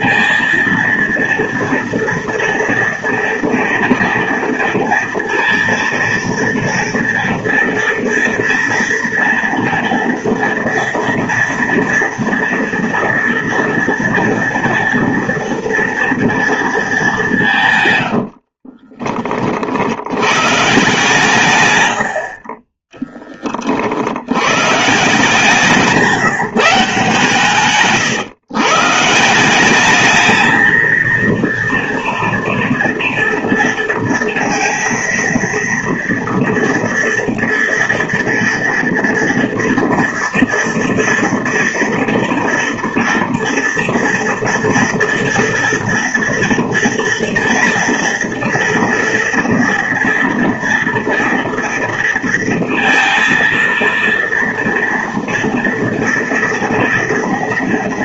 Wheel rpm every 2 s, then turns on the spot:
230, 230, 230, 230, 230, 230, 230, 230, 230, 70, 130, 40, 120, 160, 130, 220, 230, 230, 230, 230, 230, 230, 230, 230, 230, 230, 230, 230, 230.
18-20 22-24